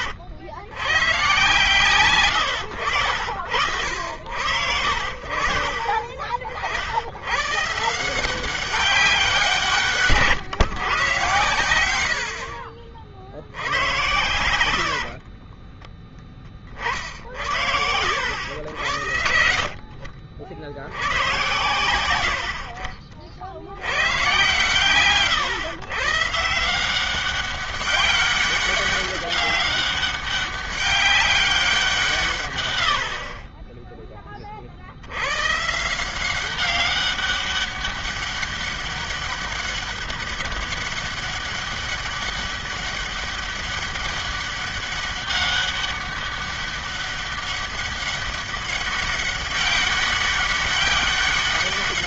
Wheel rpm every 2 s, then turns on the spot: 90, 110, 80, 50, 180, 150, 70, 100, 30, 80, 70, 70, 110, 160, 200, 200, 140, 30, 190, 200, 200, 200, 200, 200, 200, 200.
14-16